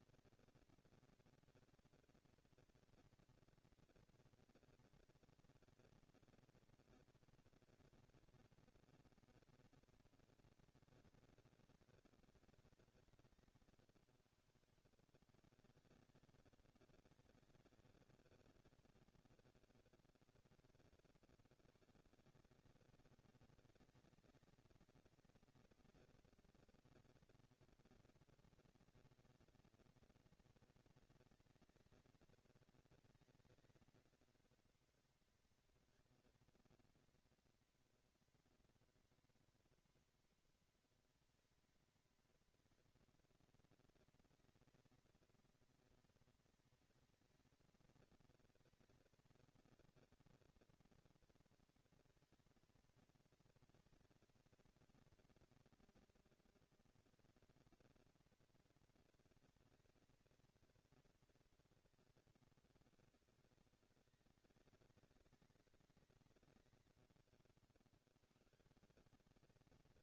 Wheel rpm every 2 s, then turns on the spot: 230, 230, 230, 230, 230, 210, 180, 100, 190, 180, 130, 210, 230, 230, 220, 220, 230, 230, 230, 230, 230, 230, 230, 220, 230, 220, 230, 230, 230, 230, 230, 200, 200, 140, 160.
none